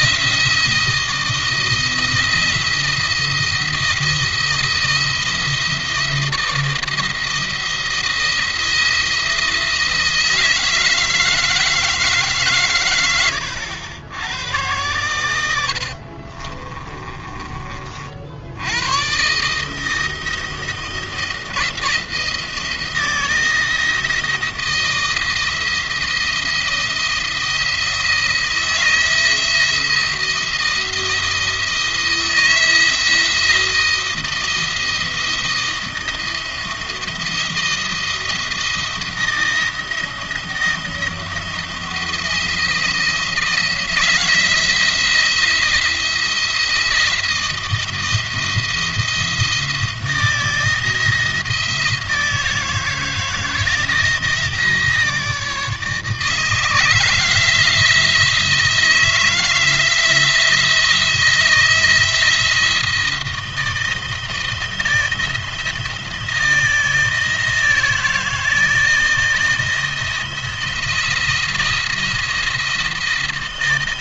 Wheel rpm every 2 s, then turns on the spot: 160, 170, 170, 160, 170, 160, 100, 100, 30, 90, 170, 170, 170, 170, 170, 170, 160, 170, 170, 170, 170, 170, 170, 170, 170, 170, 160, 160, 160, 160, 160, 160, 160, 160, 160, 170, 170.
16-18